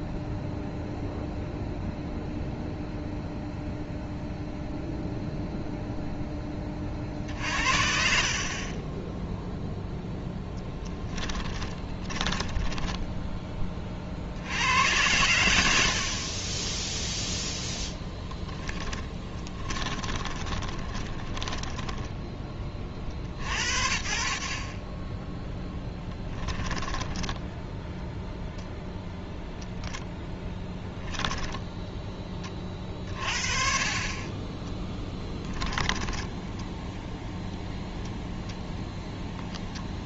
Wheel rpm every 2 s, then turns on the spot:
0, 0, 0, 30, 30, 10, 20, 80, 10, 10, 20, 30, 40, 10, 0, 10, 30, 20, 10, 10.
10-14 18-22 26-28 34-38